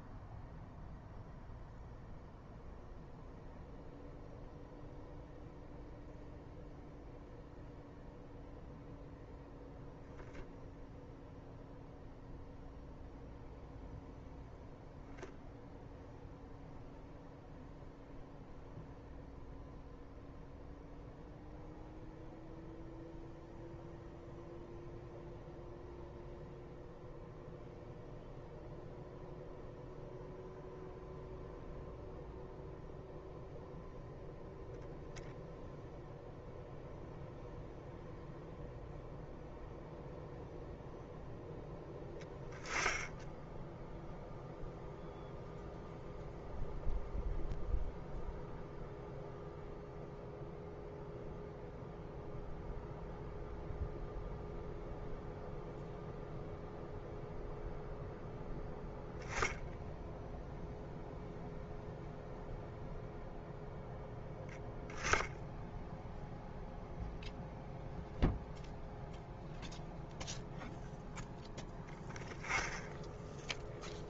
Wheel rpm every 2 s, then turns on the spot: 0, 0, 0, 0, 0, 0, 0, 0, 0, 0, 0, 0, 0, 0, 0, 0, 0, 0, 0, 0, 0, 20, 0, 0, 0, 0, 0, 0, 0, 0, 0, 0, 0, 0, 0, 0, 0.
none